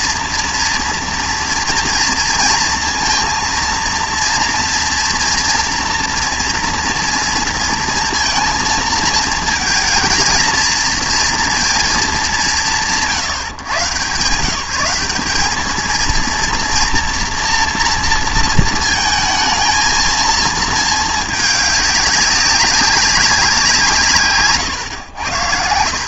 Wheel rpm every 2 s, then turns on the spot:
230, 230, 230, 230, 220, 230, 180, 170, 240, 230, 220, 200, 120.
none